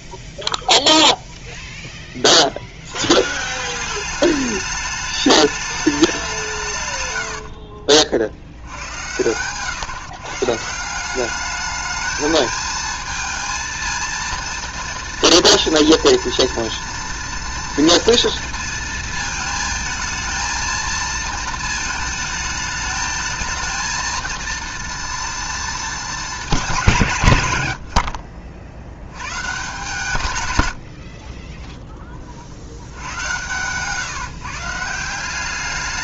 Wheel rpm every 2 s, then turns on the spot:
0, 60, 210, 150, 80, 160, 220, 230, 230, 230, 230, 220, 230, 190, 70, 80, 70, 160.
30-32